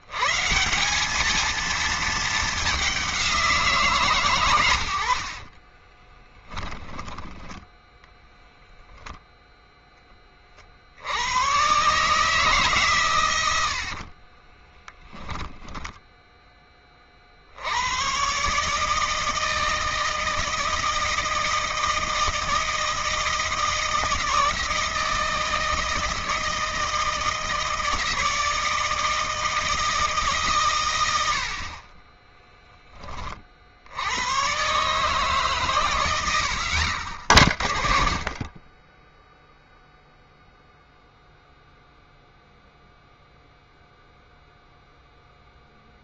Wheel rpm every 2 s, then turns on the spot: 170, 210, 90, 10, 0, 70, 130, 10, 30, 160, 160, 160, 160, 160, 160, 110, 20, 140, 70, 20, 0, 0, 0.
6-8 14-16 30-32 36-38